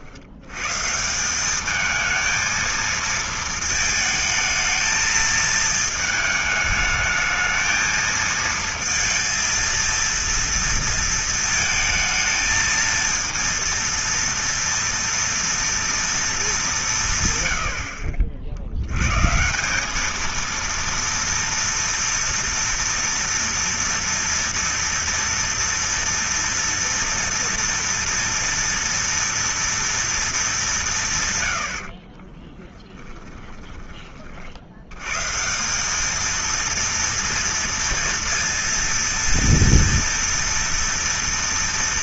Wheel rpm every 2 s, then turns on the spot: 100, 220, 220, 220, 230, 230, 220, 230, 220, 60, 220, 230, 230, 230, 230, 220, 30, 50, 220, 240, 230.
32-34